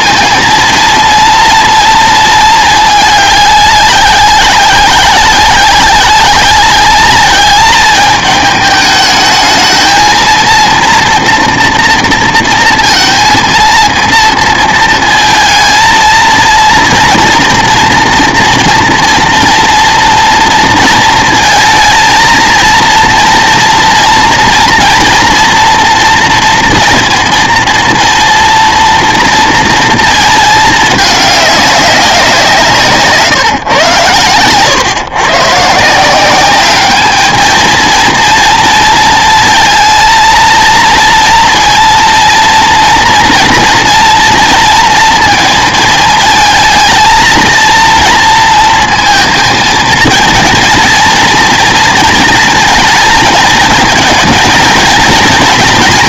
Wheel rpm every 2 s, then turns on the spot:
230, 220, 190, 200, 210, 230, 230, 230, 230, 230, 230, 230, 230, 230, 230, 220, 170, 120, 210, 230, 230, 230, 230, 220, 230, 230, 220, 230.
none